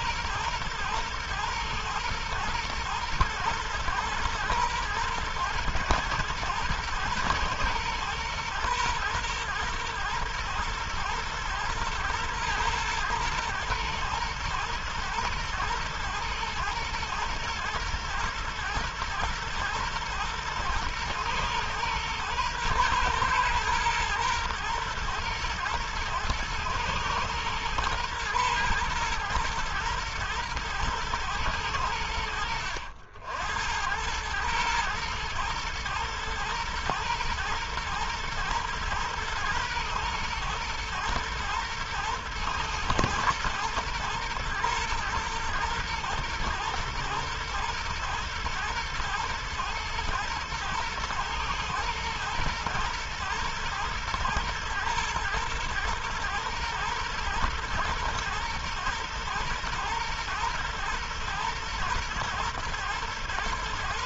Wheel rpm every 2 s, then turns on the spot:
110, 110, 120, 110, 120, 120, 110, 110, 110, 110, 120, 120, 110, 110, 110, 110, 70, 110, 110, 120, 110, 110, 110, 120, 110, 110, 120, 110, 110, 120, 110, 120.
none